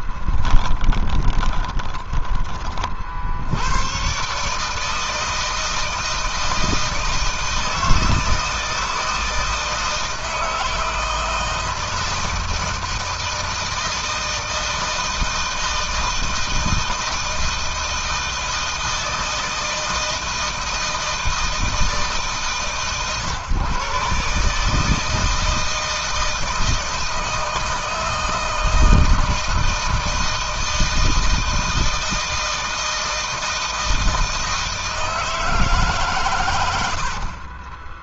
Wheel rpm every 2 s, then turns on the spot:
20, 70, 160, 160, 160, 160, 160, 160, 160, 160, 160, 130, 160, 160, 160, 160, 160, 160, 60.
0-2 36-38